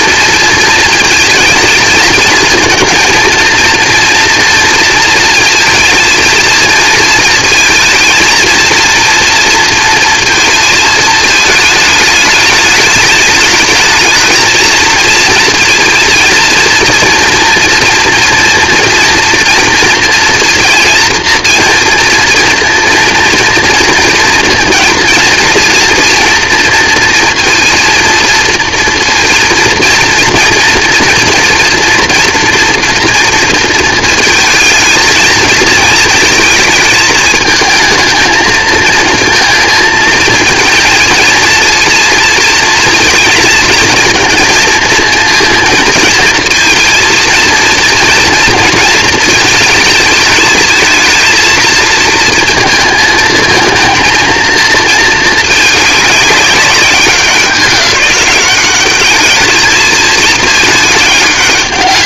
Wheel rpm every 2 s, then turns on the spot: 230, 220, 230, 230, 230, 230, 220, 220, 230, 230, 230, 230, 230, 230, 230, 230, 230, 220, 220, 220, 230, 230, 230, 230, 230, 220, 230, 220, 200, 200, 210.
none